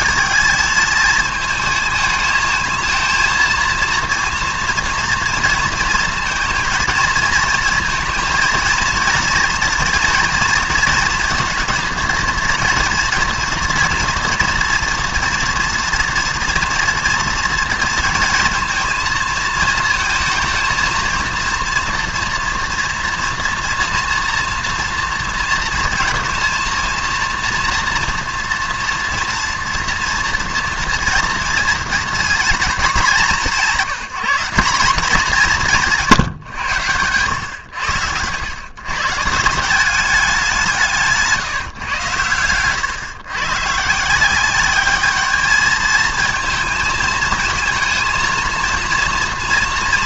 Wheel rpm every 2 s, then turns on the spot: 220, 220, 230, 230, 230, 230, 230, 240, 240, 230, 230, 230, 230, 230, 230, 230, 220, 200, 110, 130, 170, 120, 200, 220, 230.
none